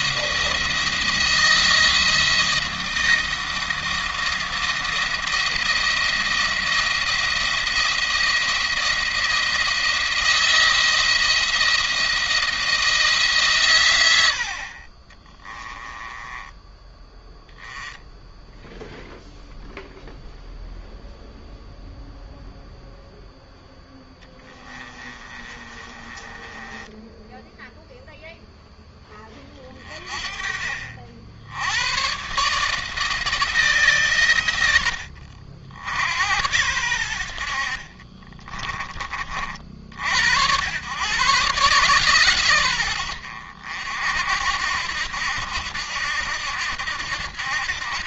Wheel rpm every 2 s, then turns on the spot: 170, 160, 170, 170, 170, 170, 150, 30, 10, 0, 0, 0, 20, 10, 20, 50, 160, 80, 80, 40, 120, 100, 80, 80.
14-16 24-28